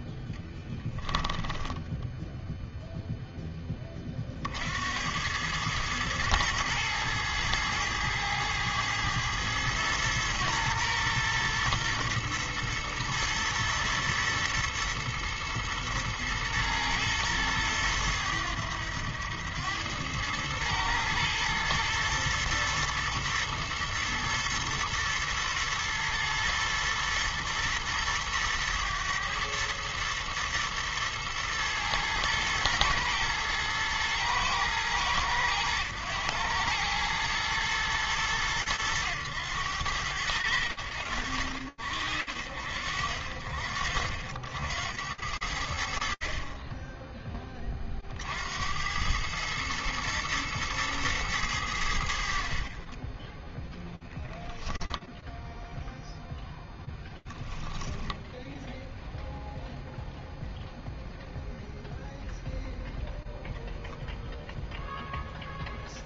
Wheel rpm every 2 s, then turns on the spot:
10, 10, 110, 110, 110, 120, 110, 110, 110, 100, 110, 110, 110, 110, 110, 110, 110, 100, 110, 100, 60, 60, 40, 60, 110, 60, 0, 0, 0, 0, 0, 0, 0.
0-2